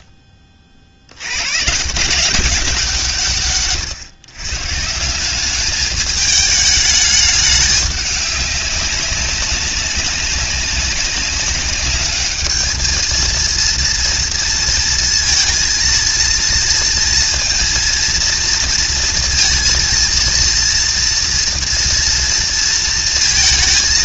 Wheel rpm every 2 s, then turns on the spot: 50, 170, 170, 210, 200, 200, 220, 230, 230, 230, 230, 230.
none